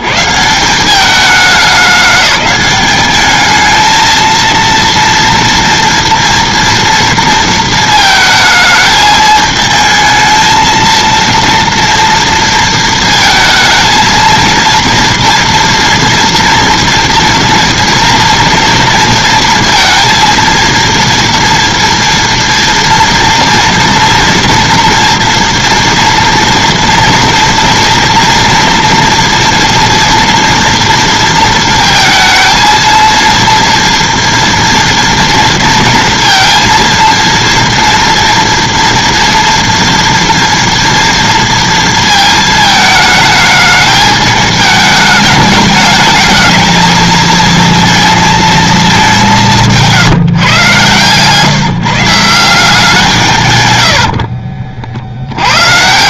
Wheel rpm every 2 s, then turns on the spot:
60, 200, 230, 230, 220, 220, 230, 230, 230, 230, 230, 230, 230, 230, 230, 240, 230, 230, 230, 240, 240, 230, 210, 220, 220, 150, 170, 70.
54-56